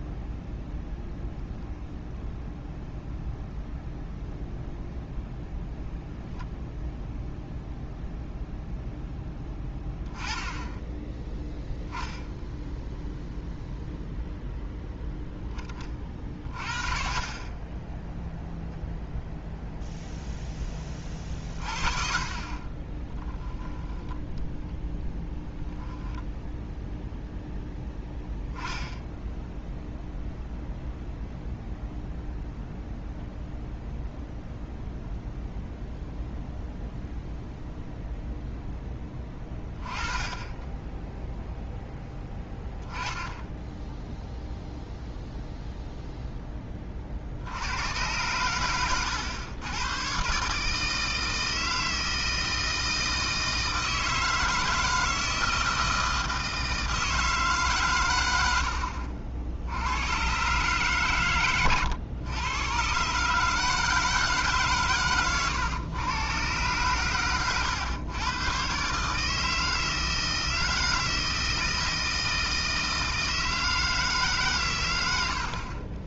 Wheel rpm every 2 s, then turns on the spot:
0, 0, 0, 0, 0, 10, 0, 0, 30, 0, 20, 20, 10, 0, 10, 0, 0, 0, 0, 10, 10, 10, 0, 20, 110, 150, 160, 160, 160, 70, 130, 120, 130, 120, 130, 160, 160, 110.
none